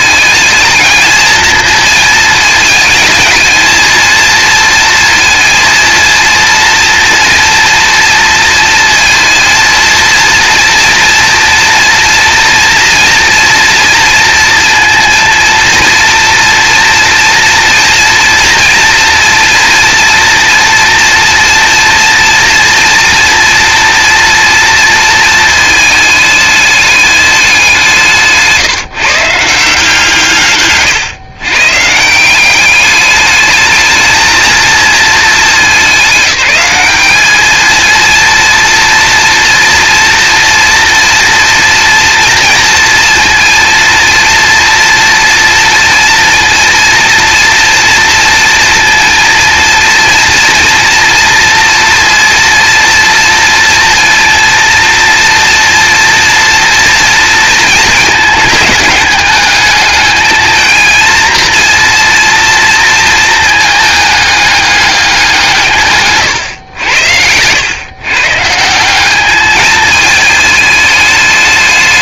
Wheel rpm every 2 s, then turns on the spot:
220, 220, 230, 230, 230, 230, 240, 230, 230, 230, 230, 240, 240, 210, 150, 140, 190, 220, 200, 230, 230, 230, 230, 230, 230, 230, 230, 230, 230, 210, 220, 230, 210, 110, 160, 220.
none